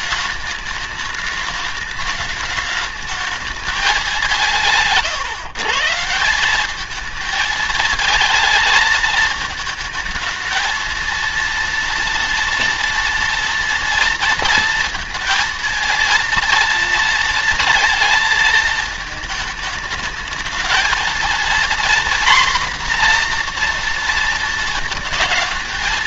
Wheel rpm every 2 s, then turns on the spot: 210, 210, 180, 200, 220, 220, 230, 230, 230, 220, 220, 250, 230.
none